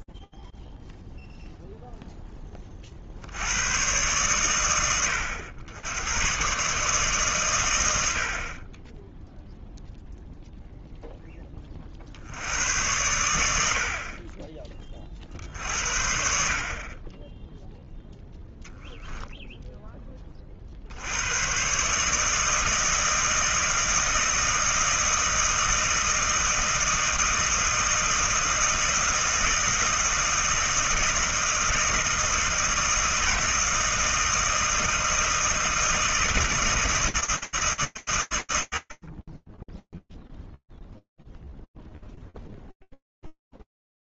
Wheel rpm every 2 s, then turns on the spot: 0, 70, 100, 140, 10, 20, 80, 60, 10, 10, 130, 160, 160, 160, 160, 160, 160, 160, 160, 20, 0, 0.
none